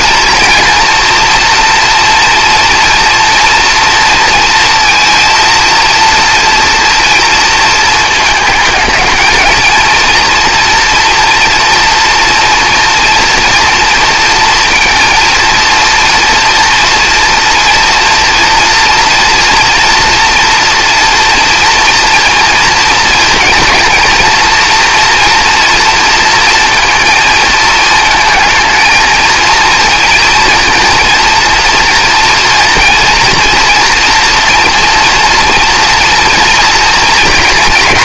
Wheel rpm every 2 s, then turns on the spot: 230, 230, 230, 230, 220, 240, 240, 230, 230, 230, 240, 230, 230, 230, 230, 230, 230, 230, 230.
none